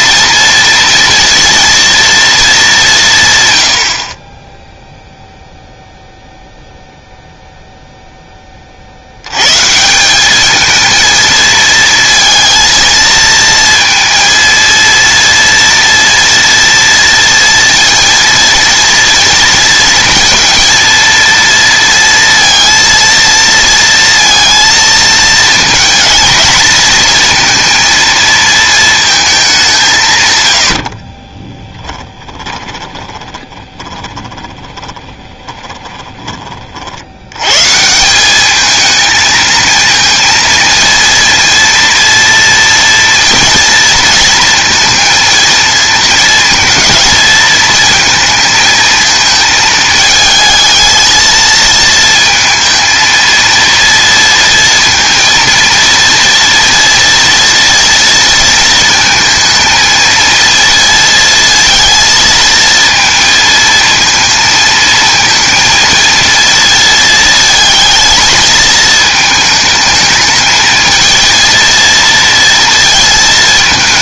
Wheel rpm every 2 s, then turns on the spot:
230, 170, 0, 0, 50, 220, 230, 230, 230, 230, 230, 230, 230, 230, 230, 80, 20, 20, 60, 220, 230, 230, 230, 230, 220, 220, 230, 230, 230, 230, 230, 230, 230, 230, 220, 220, 230.
30-36